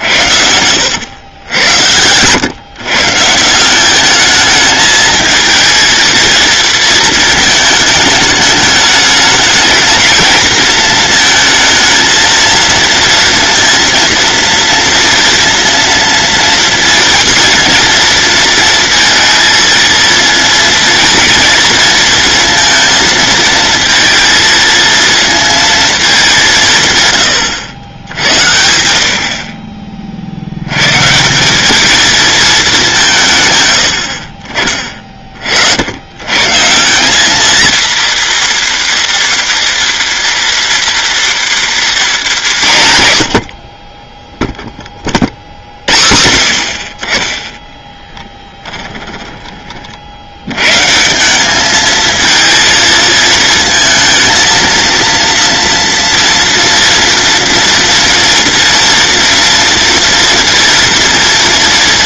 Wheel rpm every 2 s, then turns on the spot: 90, 140, 220, 230, 210, 230, 230, 230, 230, 230, 220, 230, 230, 150, 70, 100, 190, 30, 170, 230, 230, 140, 30, 50, 20, 140, 230, 230, 230, 230, 230.
48-50